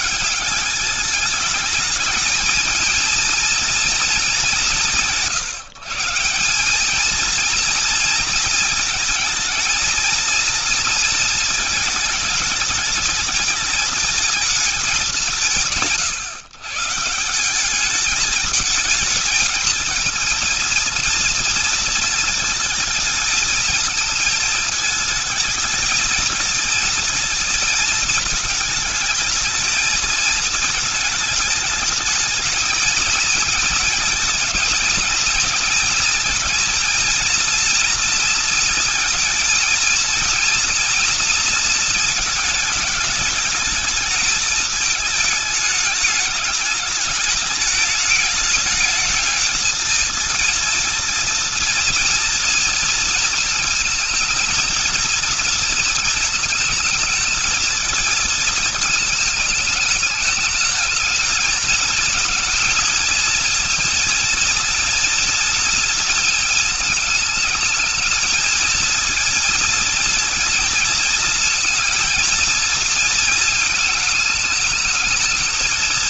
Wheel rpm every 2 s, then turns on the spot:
180, 220, 190, 200, 230, 230, 210, 210, 150, 220, 230, 220, 220, 220, 220, 220, 230, 230, 230, 230, 230, 210, 220, 210, 220, 230, 230, 220, 220, 220, 220, 230, 230, 220, 220, 230, 220, 220.
none